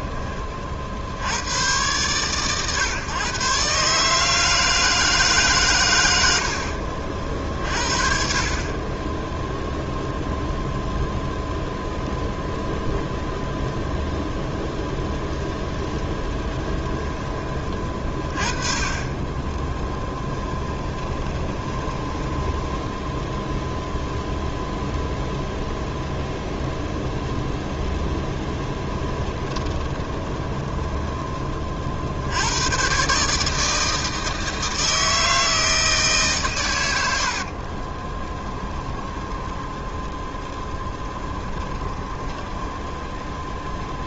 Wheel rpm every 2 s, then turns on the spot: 50, 130, 160, 50, 20, 0, 0, 0, 10, 20, 10, 10, 0, 0, 10, 20, 140, 160, 80, 10, 10, 10.
20-24 28-30 38-44